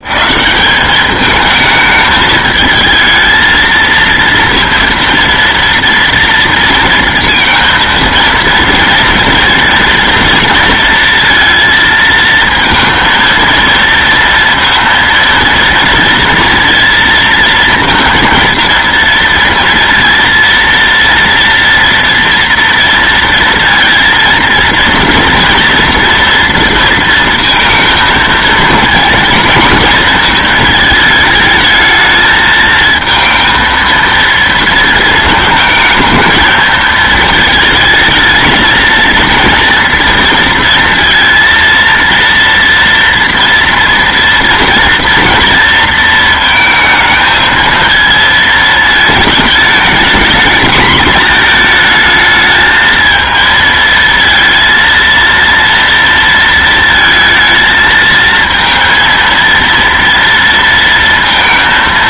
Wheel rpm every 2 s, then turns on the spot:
120, 220, 230, 230, 230, 230, 230, 230, 230, 230, 230, 230, 230, 230, 230, 230, 220, 230, 220, 220, 230, 230, 230, 230, 230, 220, 220, 230, 230, 220, 230.
none